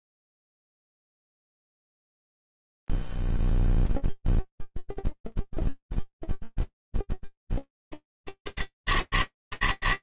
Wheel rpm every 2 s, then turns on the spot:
0, 0, 0, 0, 100.
none